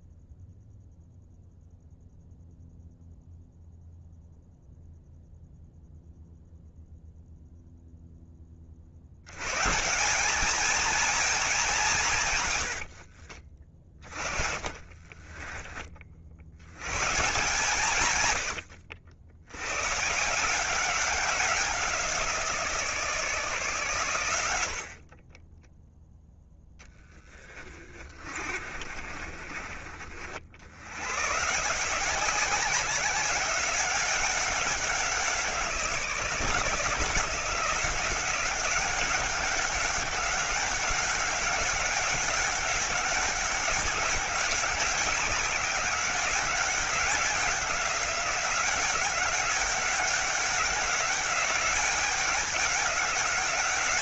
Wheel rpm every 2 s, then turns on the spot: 0, 0, 0, 0, 30, 220, 80, 30, 110, 70, 190, 160, 60, 0, 40, 90, 190, 190, 170, 190, 190, 200, 190, 190, 190, 200, 200.
12-16 28-30